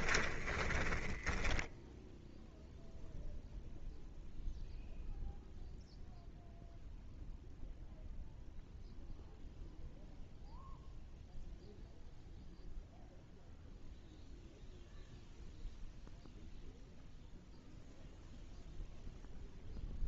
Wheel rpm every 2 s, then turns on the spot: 20, 0, 0, 0, 0, 0, 0, 0, 0, 0.
0-2